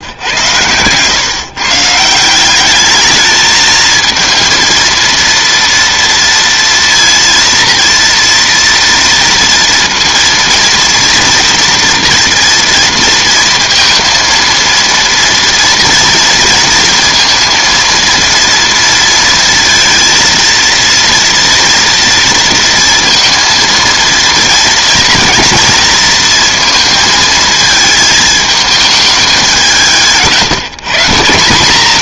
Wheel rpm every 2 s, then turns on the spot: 110, 190, 230, 230, 230, 230, 230, 230, 230, 230, 230, 230, 230, 230, 220, 160.
none